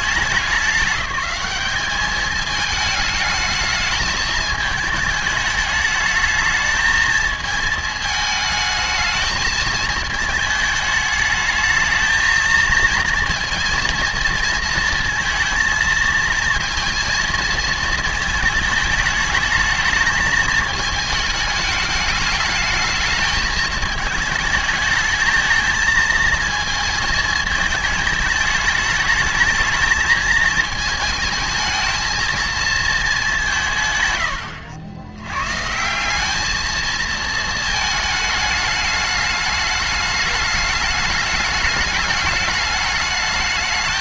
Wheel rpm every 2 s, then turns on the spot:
200, 220, 220, 220, 220, 210, 230, 230, 230, 220, 220, 220, 220, 220, 220, 220, 230, 90, 220, 210, 210, 210.
none